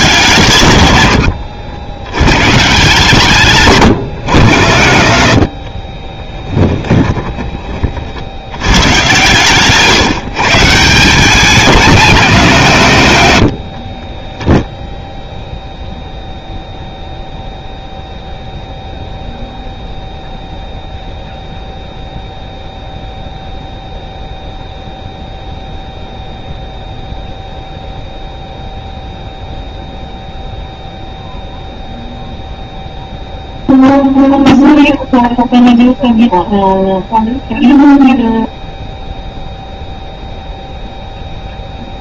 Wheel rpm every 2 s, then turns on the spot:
130, 130, 90, 10, 100, 160, 160, 20, 0, 0, 0, 0, 0, 0, 0, 0, 0, 0, 0, 0, 0.
6-8 14-16